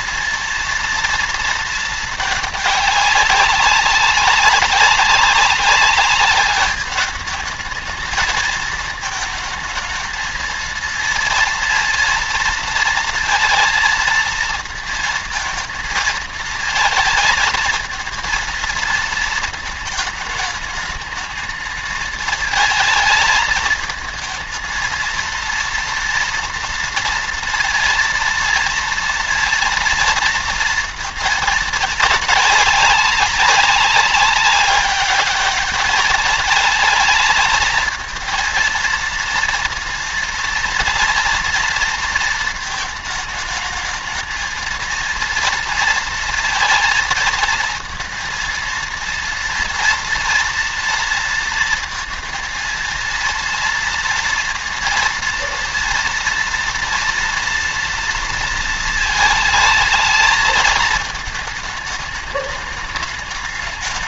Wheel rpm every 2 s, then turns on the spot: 230, 200, 190, 200, 220, 220, 230, 230, 230, 230, 210, 220, 220, 230, 230, 230, 200, 200, 220, 230, 230, 220, 220, 230, 230, 230, 230, 230, 230, 230, 220, 210.
none